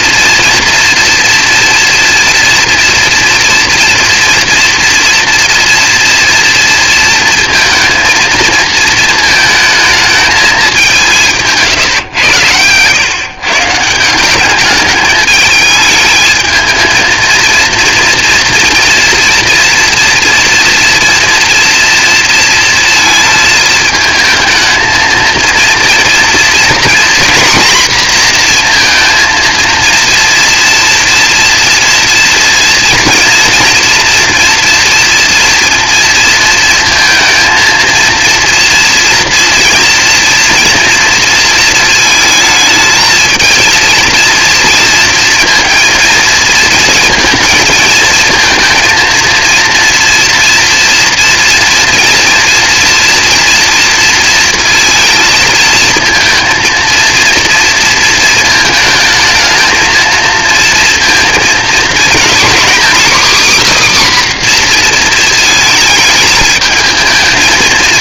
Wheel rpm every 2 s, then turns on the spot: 240, 230, 230, 230, 220, 200, 110, 210, 220, 230, 230, 230, 220, 240, 240, 230, 230, 230, 230, 230, 230, 220, 230, 230, 230, 230, 230, 230, 230, 220, 230, 260, 250, 220.
none